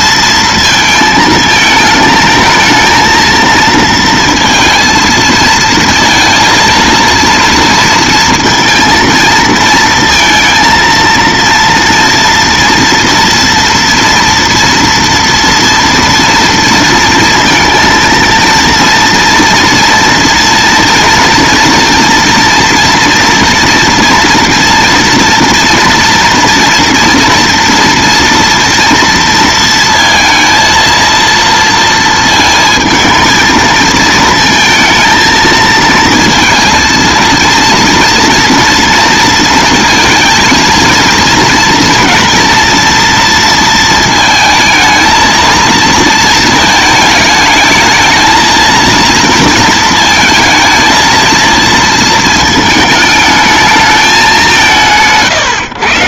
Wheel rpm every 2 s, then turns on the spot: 230, 220, 230, 230, 230, 230, 230, 230, 230, 230, 230, 230, 230, 230, 240, 230, 220, 220, 230, 230, 230, 240, 220, 220, 230, 220, 220, 170.
none